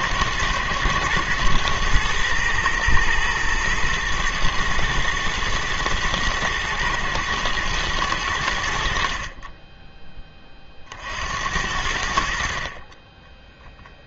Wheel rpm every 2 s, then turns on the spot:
110, 120, 110, 110, 80, 30, 50.
none